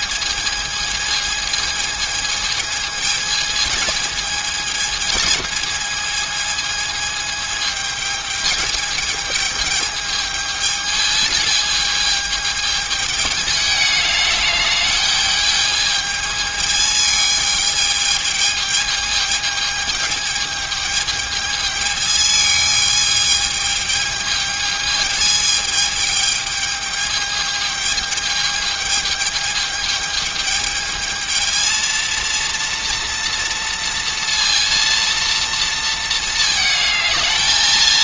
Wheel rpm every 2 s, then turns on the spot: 220, 220, 220, 220, 210, 220, 210, 210, 220, 220, 210, 210, 220, 210, 220, 220, 230, 230, 220.
none